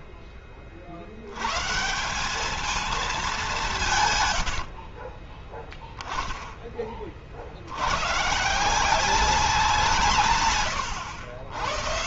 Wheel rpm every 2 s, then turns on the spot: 50, 210, 60, 30, 180, 100.
4-6